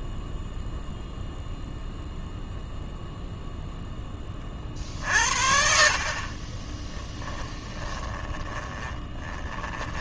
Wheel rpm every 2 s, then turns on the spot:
0, 0, 40, 20, 20.
6-10